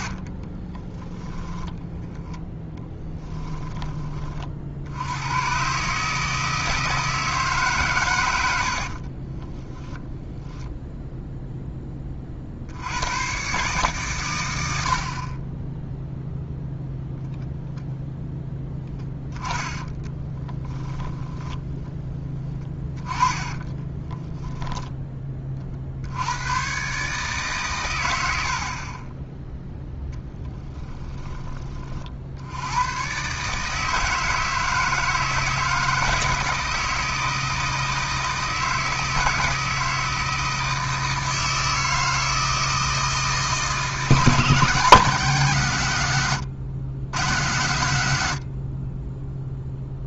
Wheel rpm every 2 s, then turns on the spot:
20, 10, 60, 160, 70, 0, 70, 90, 0, 10, 10, 30, 0, 120, 50, 10, 80, 160, 160, 160, 160, 160, 160, 110, 50.
0-4 8-10 20-24